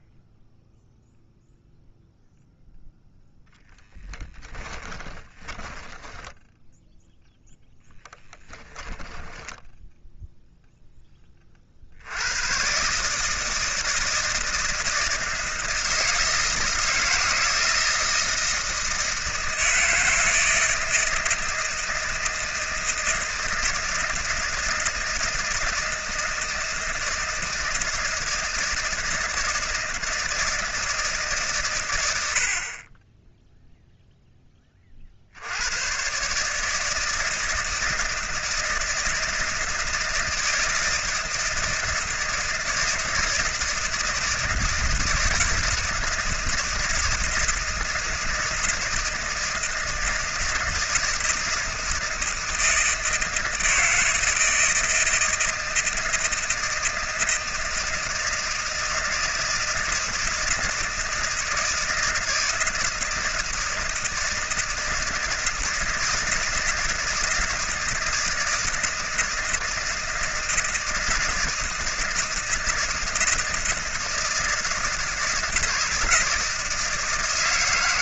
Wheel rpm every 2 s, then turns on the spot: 0, 0, 20, 0, 10, 10, 130, 160, 160, 160, 160, 160, 160, 160, 160, 160, 40, 20, 150, 160, 160, 160, 160, 160, 160, 160, 160, 160, 160, 160, 160, 160, 160, 160, 160, 160, 160, 160, 160.
4-6 8-10